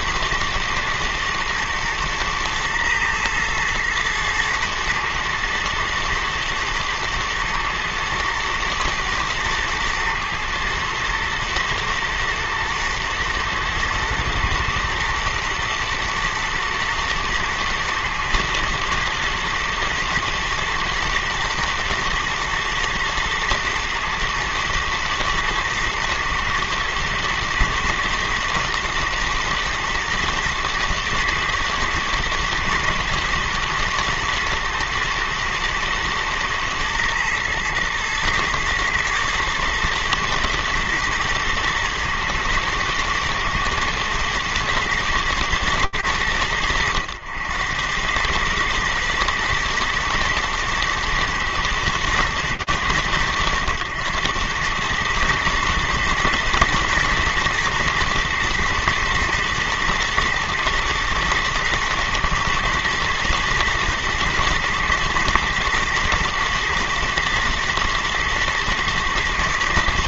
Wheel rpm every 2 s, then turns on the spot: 110, 120, 110, 110, 120, 110, 110, 110, 110, 110, 120, 110, 110, 110, 120, 110, 120, 120, 110, 110, 110, 110, 110, 90, 120, 110, 100, 110, 110, 120, 120, 110, 110, 120, 120.
none